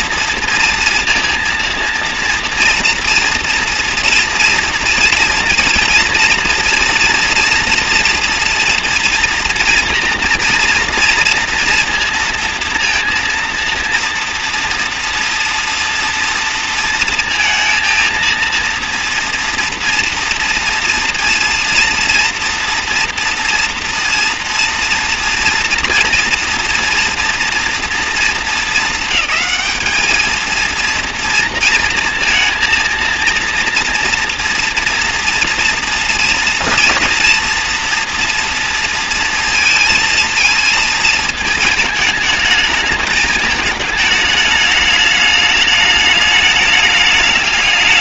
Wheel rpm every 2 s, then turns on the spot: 230, 230, 230, 230, 230, 230, 230, 240, 230, 230, 230, 230, 230, 230, 220, 220, 230, 230, 230, 230, 230, 220, 210, 210.
none